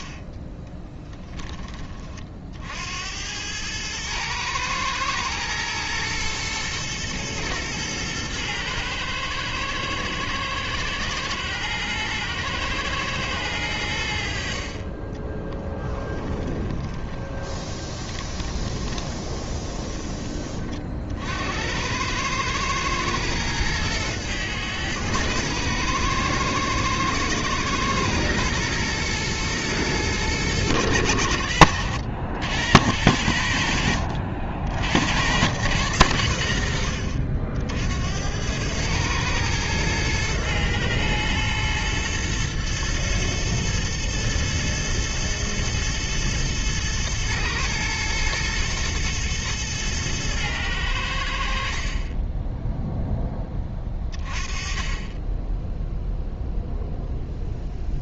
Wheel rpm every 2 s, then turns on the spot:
30, 70, 120, 120, 110, 120, 110, 30, 20, 20, 40, 110, 110, 110, 110, 110, 90, 80, 60, 110, 110, 120, 120, 110, 110, 100, 0, 20, 0.
16-20